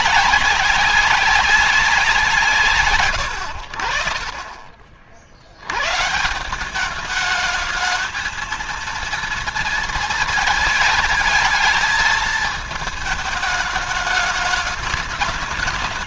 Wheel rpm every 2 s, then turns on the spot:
200, 140, 40, 200, 230, 230, 220, 210.
none